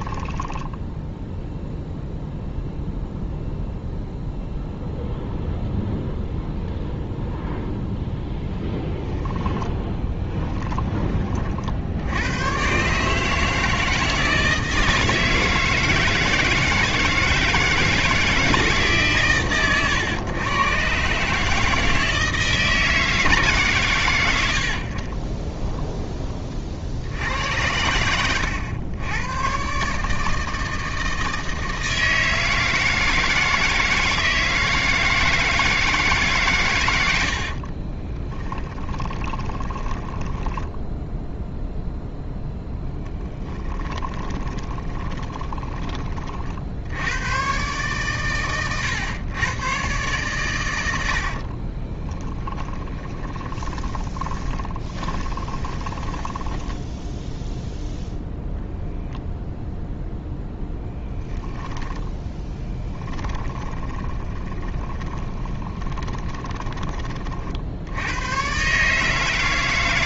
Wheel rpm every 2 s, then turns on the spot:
10, 0, 0, 0, 0, 20, 130, 160, 160, 150, 130, 160, 50, 50, 100, 160, 160, 160, 110, 20, 10, 10, 20, 80, 110, 100, 20, 20, 0, 0, 10, 10, 20, 20, 140.
0-2 10-12 38-42 44-46 52-56 62-66